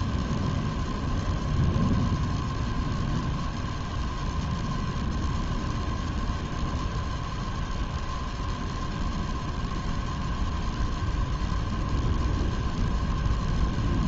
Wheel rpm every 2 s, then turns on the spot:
0, 0, 0, 0, 0, 0, 0.
none